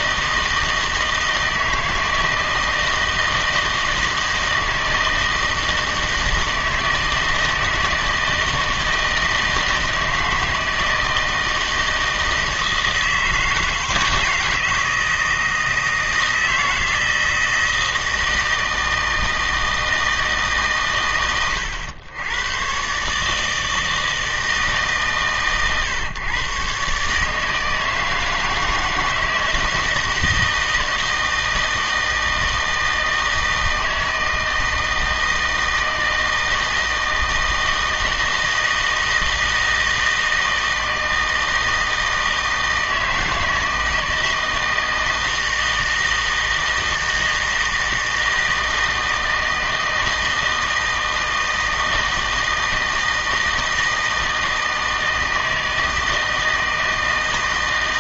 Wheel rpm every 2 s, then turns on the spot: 160, 160, 160, 160, 160, 160, 160, 160, 160, 170, 130, 130, 150, 130, 160, 160, 160, 160, 160, 160, 160, 160, 160, 160, 160, 160, 160, 160, 160.
none